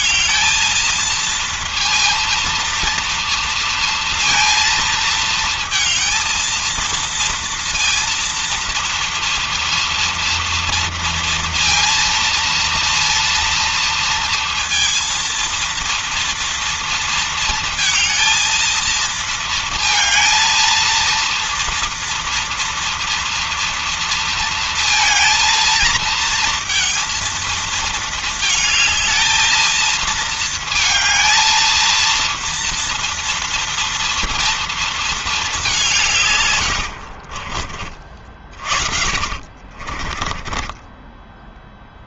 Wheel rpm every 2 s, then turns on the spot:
230, 230, 230, 230, 230, 230, 230, 230, 230, 230, 230, 230, 230, 230, 220, 230, 230, 230, 130, 40, 20.
36-42